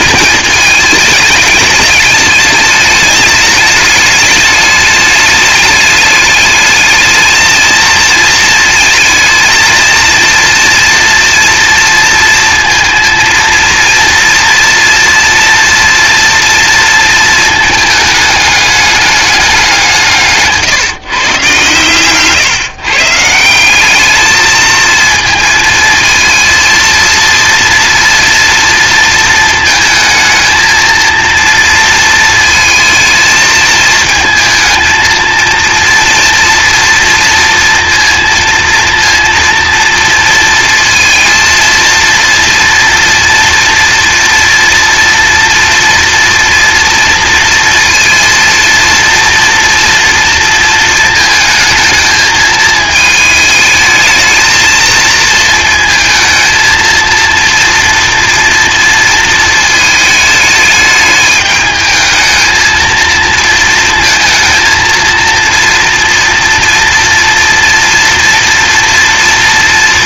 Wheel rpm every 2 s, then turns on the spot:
220, 210, 210, 210, 220, 230, 230, 230, 230, 210, 150, 140, 220, 230, 230, 230, 220, 220, 230, 230, 230, 230, 240, 230, 230, 230, 220, 220, 230, 230, 210, 220, 230, 230, 240.
none